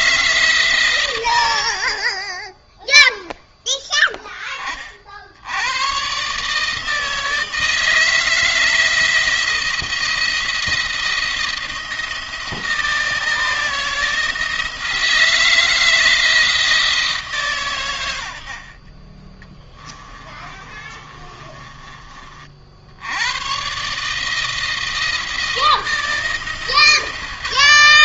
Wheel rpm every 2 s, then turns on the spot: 140, 10, 30, 150, 160, 170, 170, 160, 160, 50, 30, 60, 160, 140.
20-22